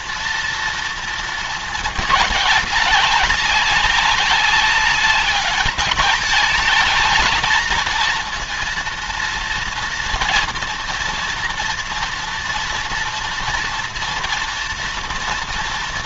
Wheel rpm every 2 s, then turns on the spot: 230, 200, 200, 220, 230, 230, 230, 230.
none